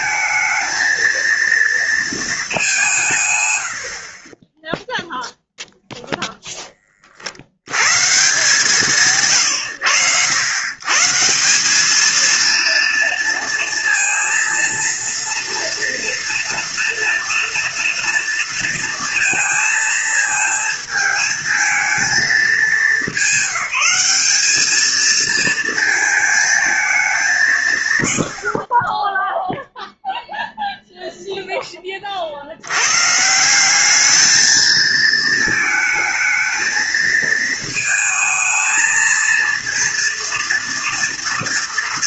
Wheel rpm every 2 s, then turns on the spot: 230, 120, 0, 60, 130, 170, 230, 230, 230, 230, 220, 200, 220, 190, 10, 0, 150, 220, 220, 230, 240.
none